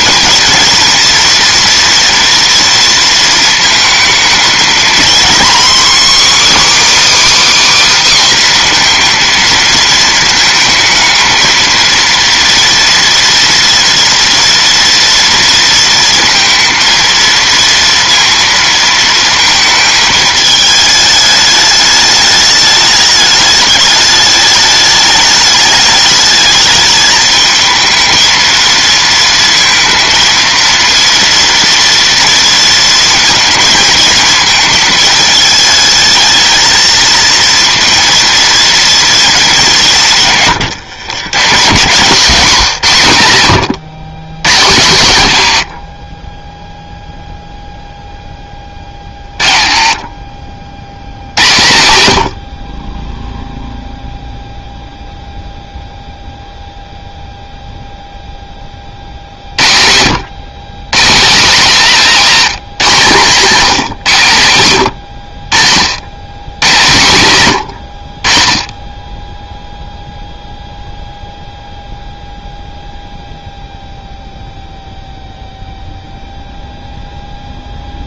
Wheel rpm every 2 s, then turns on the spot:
230, 230, 230, 300, 240, 220, 230, 230, 230, 230, 210, 210, 210, 220, 230, 230, 230, 220, 220, 230, 130, 190, 160, 0, 30, 80, 40, 0, 0, 50, 180, 200, 100, 120, 10, 0, 0, 0, 0.
none